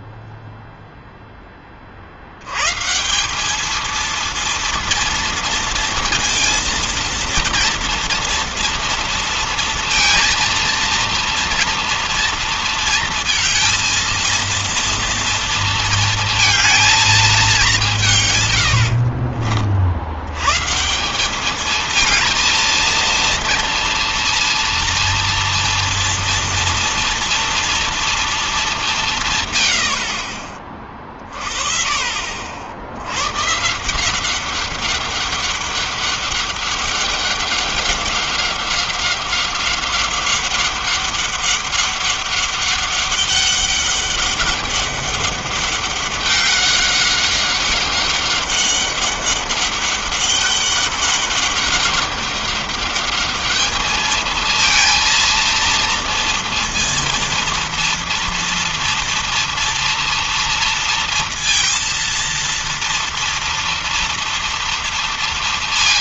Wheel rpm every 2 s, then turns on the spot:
10, 170, 230, 230, 230, 230, 230, 230, 210, 60, 170, 230, 230, 230, 150, 30, 120, 200, 200, 190, 200, 200, 200, 190, 200, 200, 210, 230, 230, 230, 230, 230, 230.
18-20